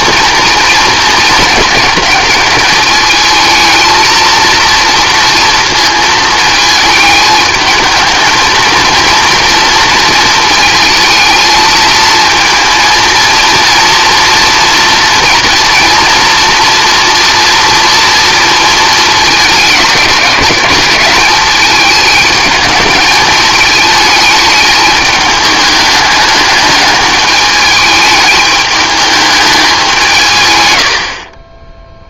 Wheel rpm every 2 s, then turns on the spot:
230, 210, 230, 220, 230, 230, 230, 230, 230, 230, 190, 220, 210, 210, 210, 110.
none